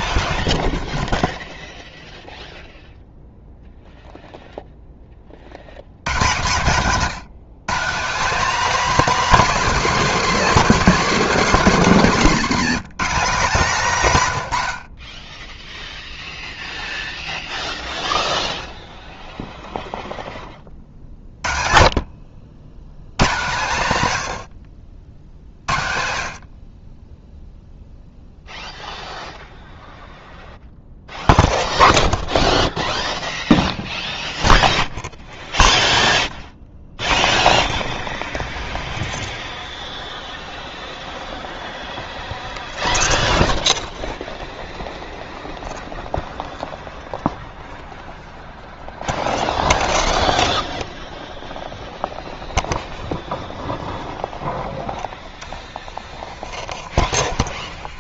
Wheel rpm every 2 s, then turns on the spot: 0, 0, 0, 160, 250, 230, 200, 80, 0, 0, 30, 80, 60, 30, 0, 0, 0, 0, 0, 0, 0, 0, 0, 0, 0, 0, 0, 0, 30.
none